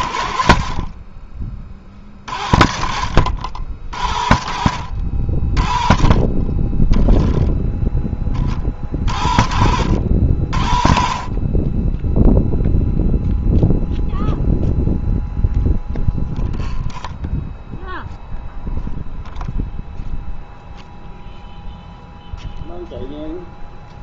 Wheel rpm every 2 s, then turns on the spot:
30, 50, 50, 20, 40, 50, 0, 0, 0, 0, 0, 0.
none